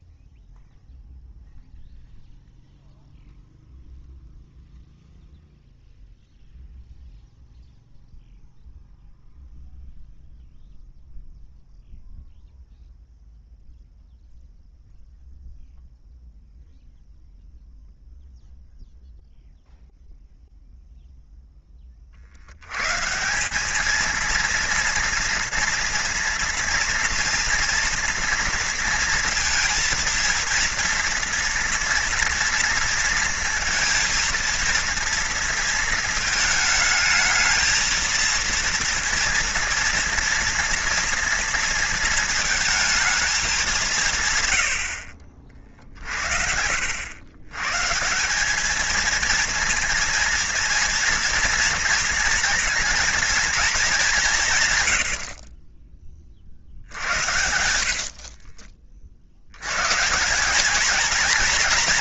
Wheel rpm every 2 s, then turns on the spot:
0, 0, 0, 0, 0, 0, 0, 0, 0, 0, 0, 110, 230, 230, 230, 230, 230, 230, 220, 230, 230, 220, 100, 80, 210, 230, 230, 120, 60, 40, 210.
none